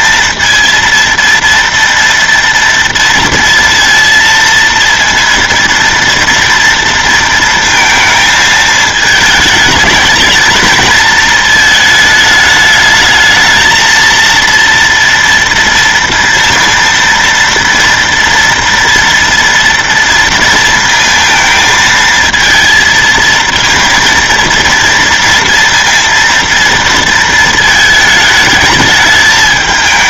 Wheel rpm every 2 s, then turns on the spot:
230, 230, 230, 230, 220, 220, 210, 230, 230, 230, 230, 230, 230, 230, 210.
none